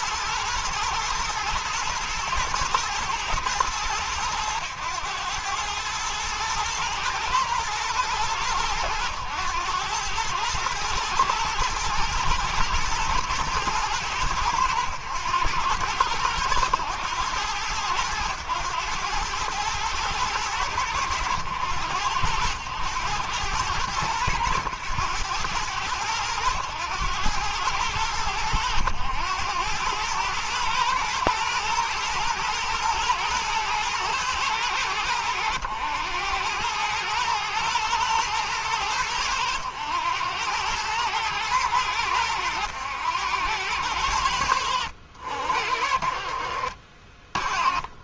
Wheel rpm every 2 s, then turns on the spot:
120, 110, 100, 110, 100, 120, 110, 100, 100, 110, 90, 100, 110, 110, 90, 110, 110, 100, 110, 110, 110, 100, 70, 40.
none